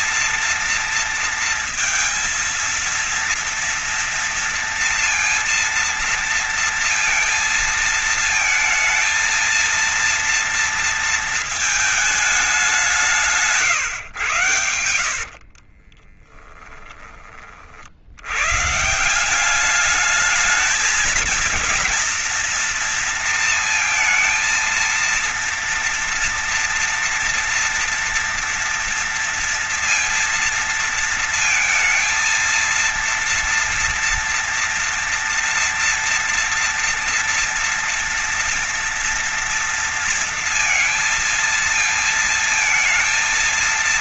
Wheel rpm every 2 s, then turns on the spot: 230, 230, 230, 230, 230, 230, 190, 100, 20, 160, 220, 230, 230, 230, 230, 230, 230, 230, 230, 230, 230, 230.
14-16